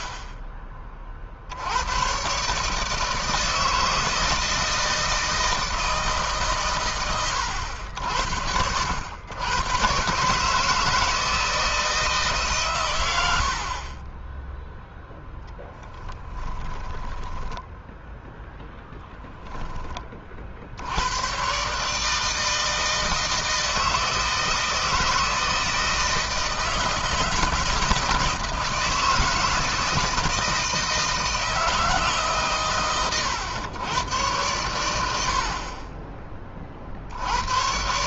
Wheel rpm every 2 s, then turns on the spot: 30, 140, 160, 140, 70, 150, 130, 10, 10, 0, 50, 160, 160, 160, 160, 160, 140, 110, 40.
16-18